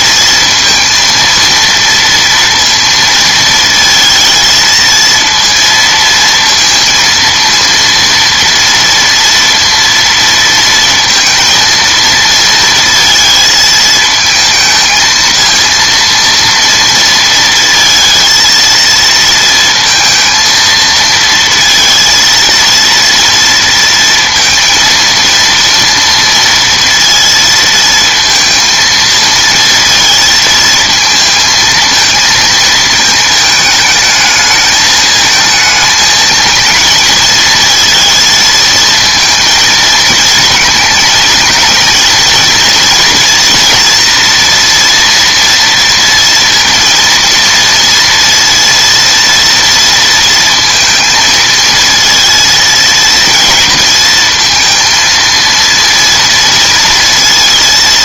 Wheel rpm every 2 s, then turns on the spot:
230, 230, 230, 230, 230, 230, 230, 220, 230, 230, 230, 230, 230, 230, 220, 230, 220, 220, 220, 230, 220, 230, 240, 230, 230, 230, 230, 220, 230.
none